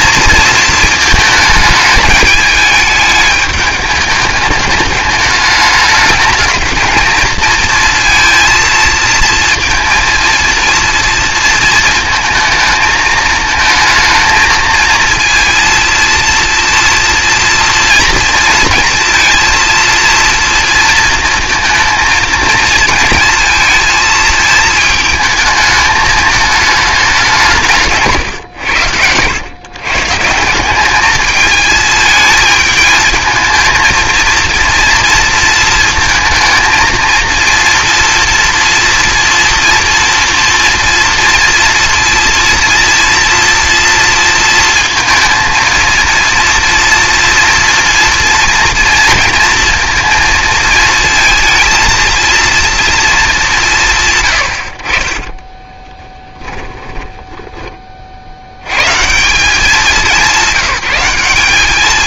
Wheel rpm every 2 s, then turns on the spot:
230, 210, 210, 220, 230, 230, 220, 230, 230, 230, 230, 220, 220, 220, 110, 180, 220, 230, 230, 240, 230, 230, 230, 230, 230, 230, 230, 70, 10, 90, 190.
56-58